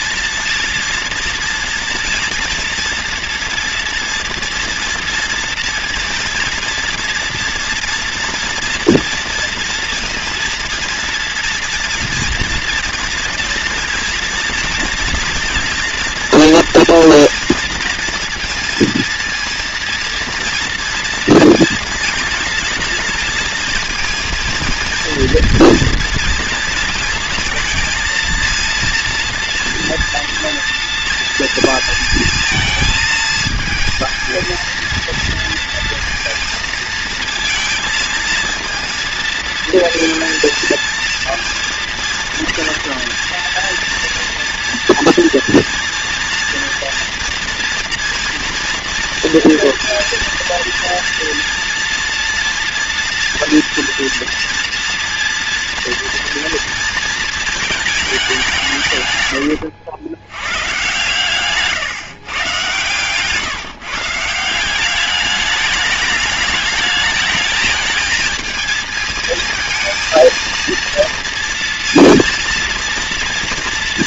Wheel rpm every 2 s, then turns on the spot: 230, 230, 230, 230, 230, 230, 230, 230, 230, 230, 240, 230, 230, 230, 230, 230, 220, 230, 230, 230, 230, 240, 240, 230, 240, 230, 230, 230, 230, 170, 120, 130, 170, 210, 220, 230, 230.
none